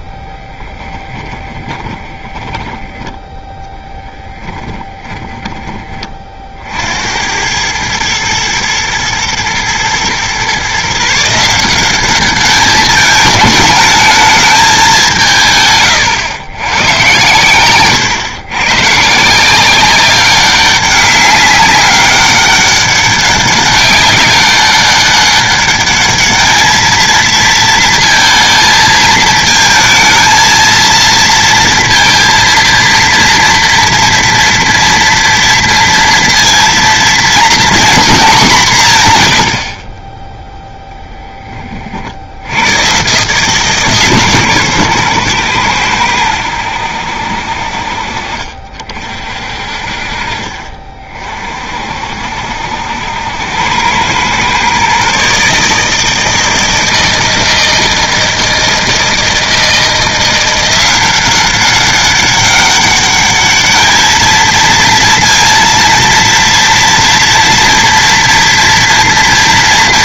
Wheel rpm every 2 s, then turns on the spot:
10, 10, 10, 70, 110, 150, 210, 190, 110, 140, 200, 200, 200, 220, 220, 230, 230, 230, 230, 160, 0, 130, 130, 80, 50, 40, 80, 140, 160, 160, 180, 200, 230, 230, 230.
0-6